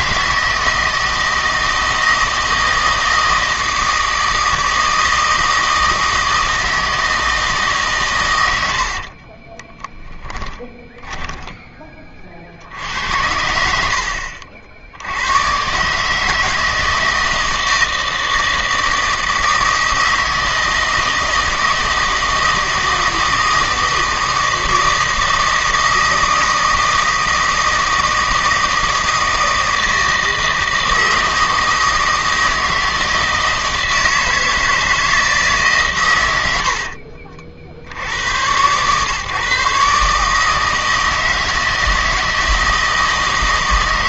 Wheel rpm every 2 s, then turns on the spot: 160, 160, 160, 160, 70, 10, 70, 70, 160, 160, 160, 160, 160, 160, 160, 160, 160, 160, 50, 120, 160, 160.
8-12 36-38